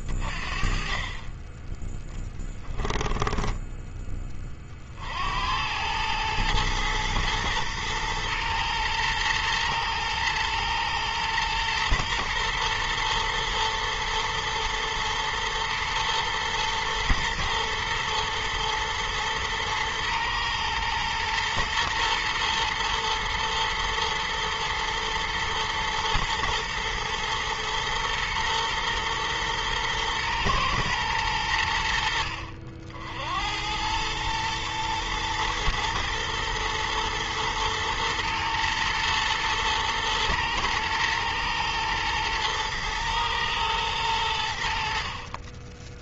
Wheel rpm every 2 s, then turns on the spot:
30, 10, 50, 110, 110, 110, 120, 110, 110, 110, 120, 120, 120, 120, 120, 110, 70, 110, 120, 120, 110, 110, 60.
none